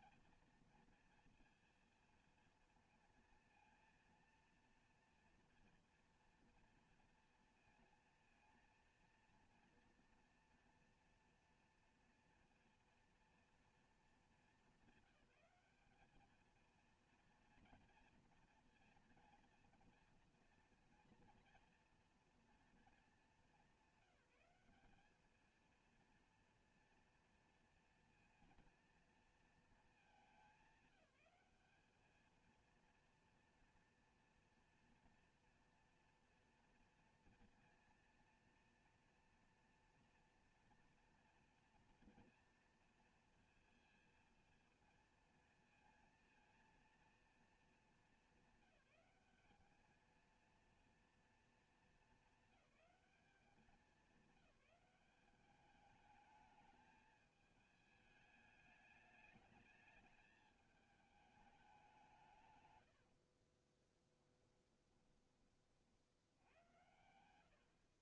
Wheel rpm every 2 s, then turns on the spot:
230, 230, 230, 230, 230, 230, 230, 200, 220, 230, 230, 230, 200, 230, 230, 210, 220, 240, 230, 230, 230, 230, 230, 230, 200, 230, 210, 200, 210, 210, 210, 130, 10, 90.
64-66